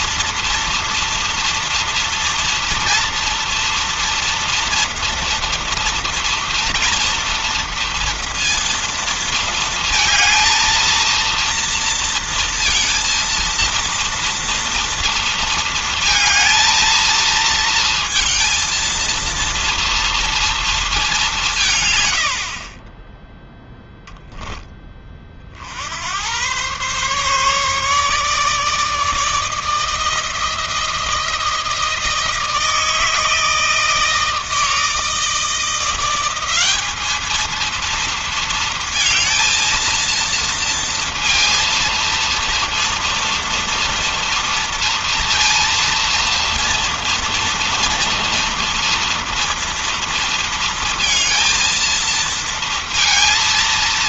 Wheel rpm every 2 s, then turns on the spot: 230, 230, 230, 240, 230, 230, 230, 230, 230, 230, 230, 70, 10, 100, 150, 160, 160, 160, 190, 230, 230, 230, 230, 230, 230, 230, 230.
none